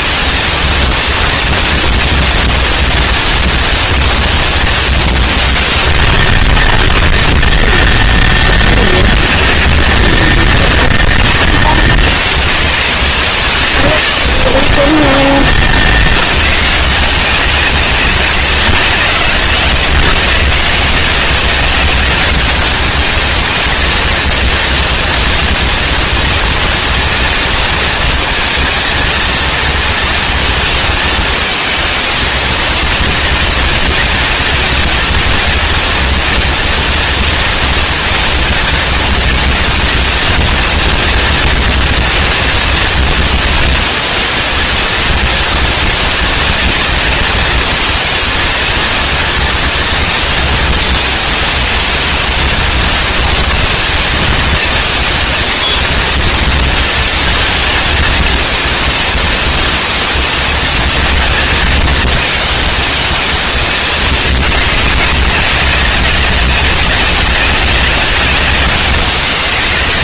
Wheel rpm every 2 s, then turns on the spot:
230, 230, 230, 40, 0, 10, 60, 50, 70, 150, 130, 210, 220, 230, 230, 240, 220, 220, 230, 230, 230, 230, 230, 230, 230, 230, 230, 220, 230, 230, 230, 220, 210, 200, 190.
6-8 10-12